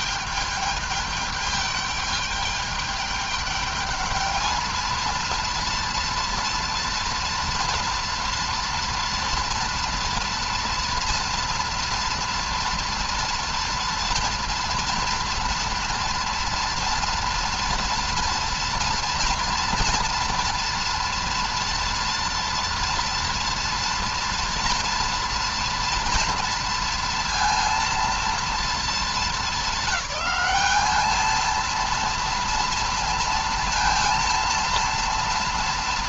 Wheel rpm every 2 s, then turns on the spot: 210, 210, 220, 230, 230, 230, 230, 230, 230, 230, 230, 240, 230, 230, 220, 200, 230, 230.
none